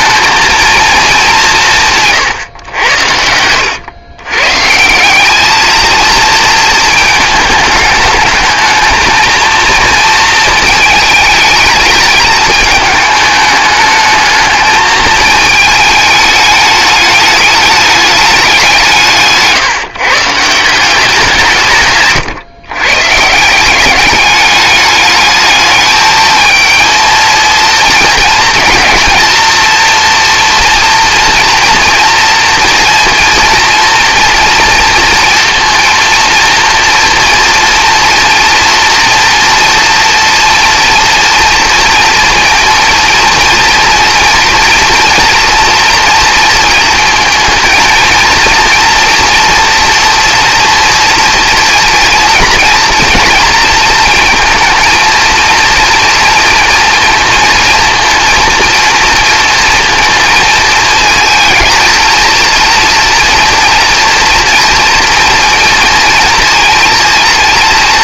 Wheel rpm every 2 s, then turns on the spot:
230, 110, 140, 230, 220, 220, 220, 220, 210, 180, 170, 130, 210, 220, 220, 230, 230, 230, 230, 230, 230, 230, 240, 220, 230, 230, 230, 230, 230, 230, 220, 230, 230, 230.
none